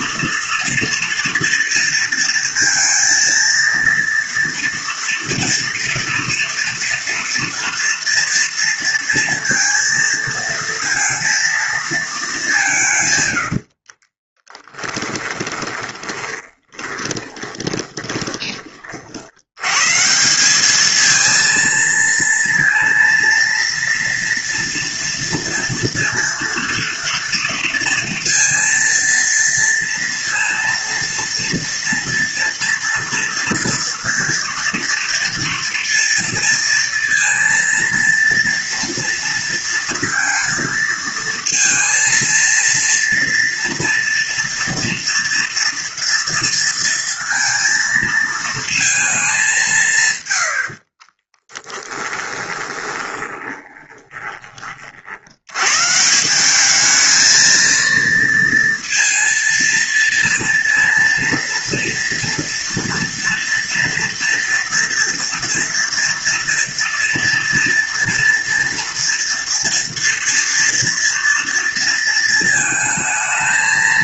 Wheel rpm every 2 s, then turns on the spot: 240, 230, 230, 230, 230, 230, 140, 10, 20, 50, 220, 230, 230, 230, 230, 230, 230, 230, 230, 230, 230, 230, 230, 230, 220, 50, 20, 50, 210, 230, 230, 230, 230, 230, 230, 230, 220.
14-18 50-54